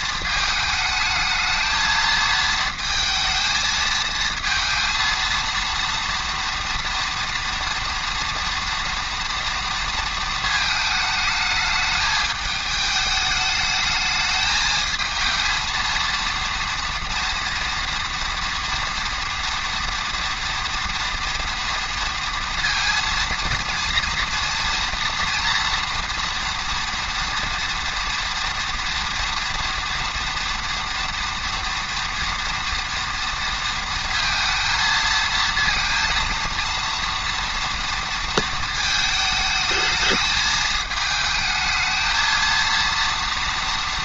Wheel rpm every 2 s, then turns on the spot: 220, 220, 230, 230, 230, 220, 210, 220, 230, 230, 230, 230, 230, 230, 240, 230, 230, 230, 230, 220, 220, 230.
none